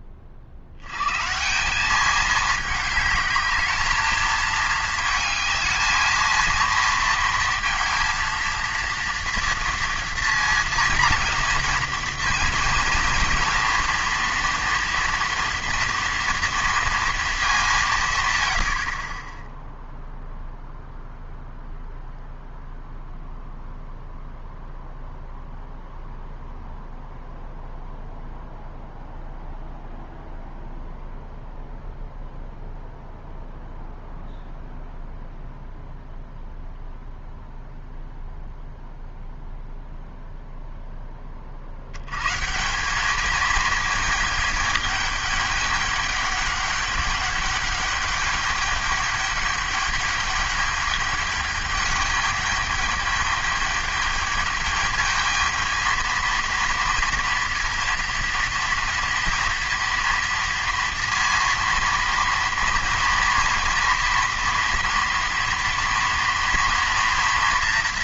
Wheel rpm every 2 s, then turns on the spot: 70, 210, 220, 230, 230, 230, 230, 230, 230, 70, 0, 0, 0, 0, 0, 0, 0, 0, 0, 0, 0, 160, 210, 200, 210, 210, 210, 220, 230, 230, 230, 230, 230, 230.
none